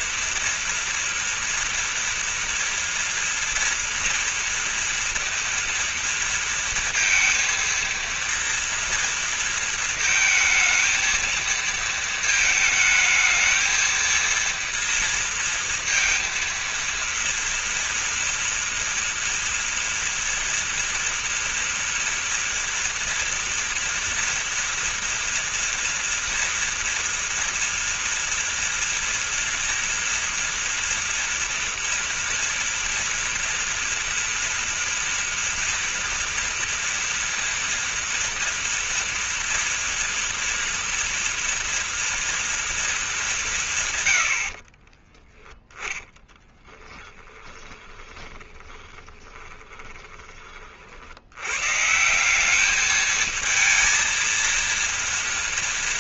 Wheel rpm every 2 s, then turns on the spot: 230, 230, 230, 230, 230, 230, 220, 230, 230, 240, 230, 230, 230, 230, 230, 240, 230, 230, 230, 240, 230, 220, 20, 10, 20, 50, 210, 230.
44-50